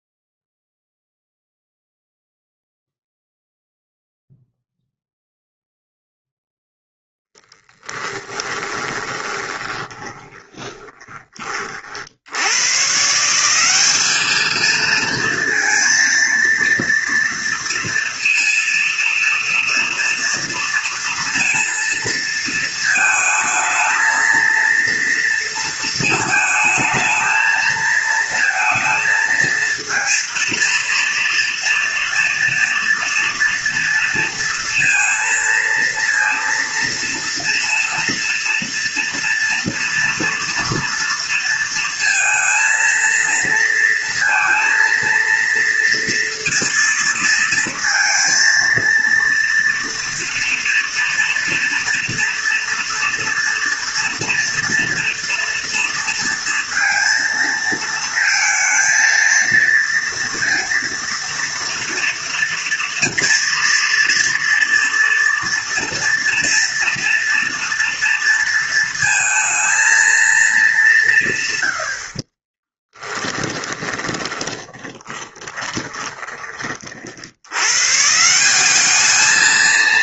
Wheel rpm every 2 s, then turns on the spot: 0, 0, 0, 0, 20, 20, 140, 220, 230, 230, 230, 220, 230, 220, 230, 230, 230, 230, 240, 230, 230, 230, 230, 230, 230, 230, 230, 240, 230, 230, 230, 240, 230, 230, 230, 190, 30, 20, 50, 210.
8-12 72-76